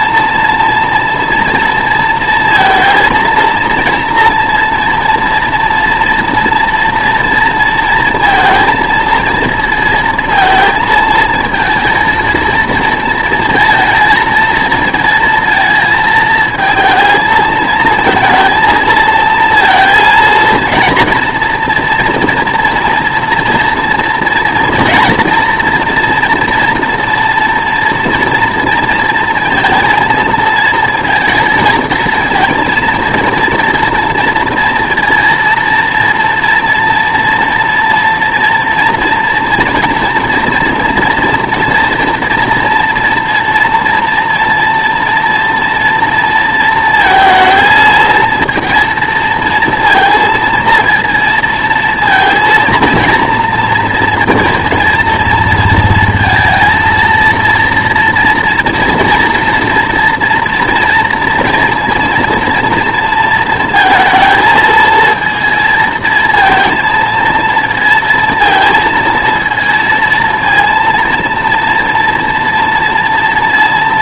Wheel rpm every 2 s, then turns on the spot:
230, 230, 230, 230, 220, 220, 220, 230, 230, 220, 230, 230, 230, 230, 230, 230, 230, 230, 240, 230, 230, 230, 240, 230, 230, 230, 230, 230, 230, 230, 230, 230, 220, 230, 230, 230, 230.
none